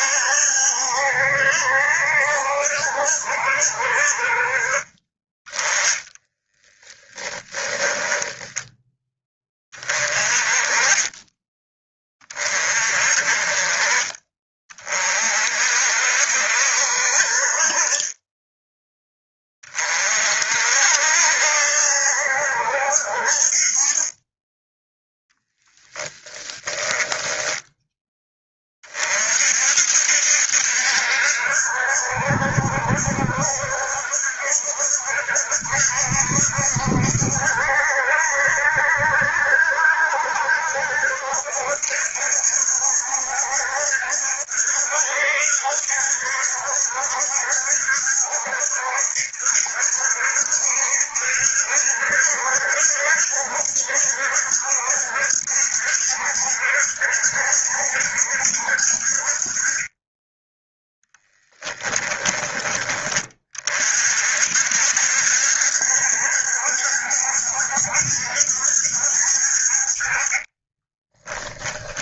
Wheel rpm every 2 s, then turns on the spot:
70, 70, 30, 10, 10, 20, 40, 40, 60, 10, 70, 60, 10, 10, 40, 70, 70, 70, 70, 70, 70, 70, 70, 70, 70, 70, 70, 70, 70, 50, 10, 20, 70, 70, 70, 20.
6-8 26-28 70-72